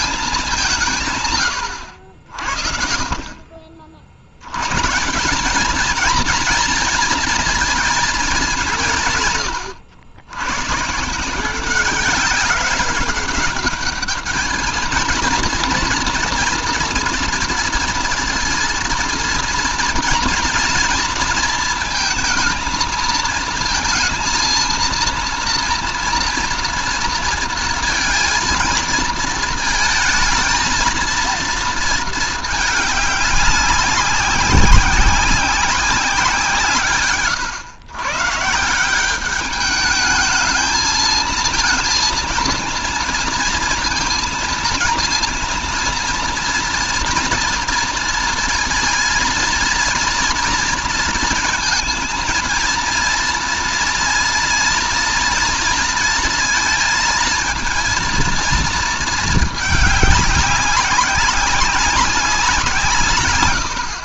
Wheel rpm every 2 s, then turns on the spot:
140, 40, 160, 230, 150, 150, 200, 230, 230, 230, 230, 230, 230, 230, 230, 220, 200, 190, 130, 190, 230, 230, 230, 230, 230, 230, 230, 230, 230, 220, 200, 140.
none